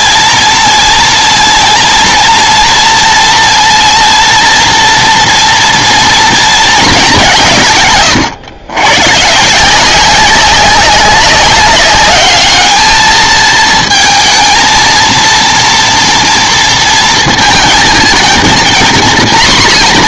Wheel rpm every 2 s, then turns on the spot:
230, 230, 230, 200, 110, 190, 220, 220, 230, 240.
none